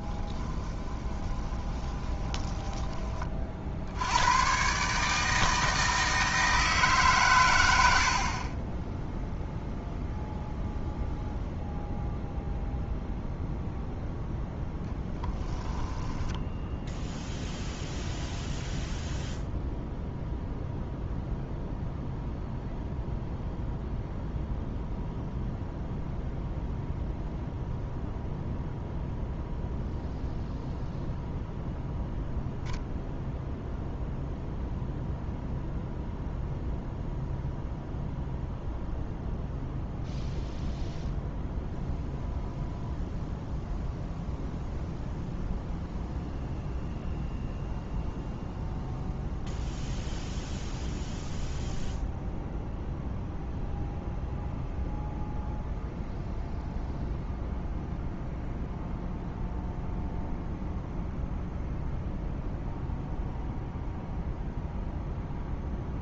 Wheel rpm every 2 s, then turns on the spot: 20, 20, 140, 150, 20, 0, 0, 0, 0, 0, 0, 0, 0, 0, 0, 0, 0, 0, 0, 0, 0, 0, 0, 0, 0, 0, 0, 0, 0, 0, 0, 0, 0.
0-2